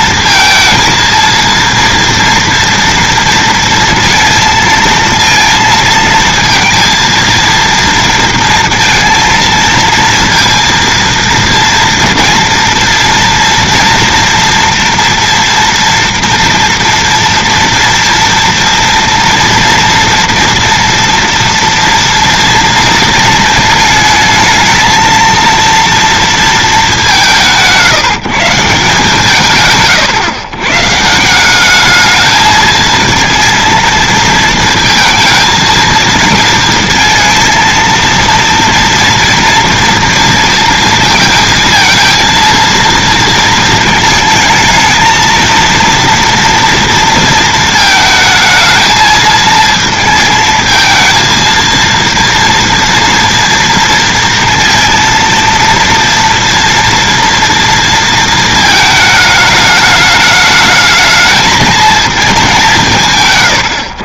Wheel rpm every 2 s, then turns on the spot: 230, 230, 230, 230, 230, 230, 230, 230, 230, 230, 230, 230, 220, 220, 160, 130, 220, 230, 230, 230, 230, 230, 220, 230, 220, 220, 230, 230, 230, 230, 210, 190.
none